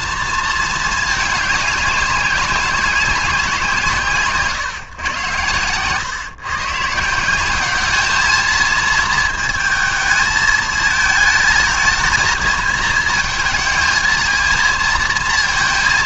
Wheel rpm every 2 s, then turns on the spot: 220, 190, 120, 150, 220, 220, 230, 230.
none